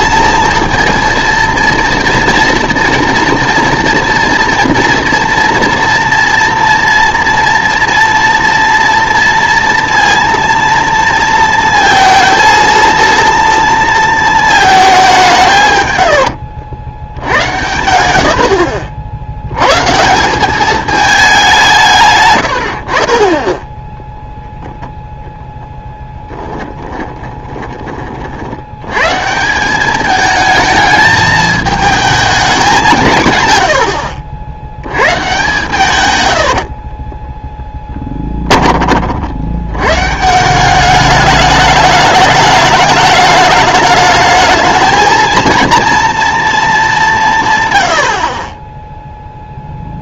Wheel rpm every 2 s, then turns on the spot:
230, 230, 230, 230, 230, 230, 230, 220, 90, 60, 200, 90, 0, 20, 90, 220, 190, 80, 60, 30, 180, 210, 220, 220, 20.
18-20 26-28 36-38